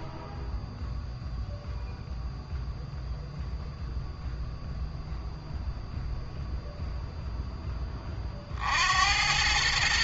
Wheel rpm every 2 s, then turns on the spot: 0, 0, 0, 0, 70.
none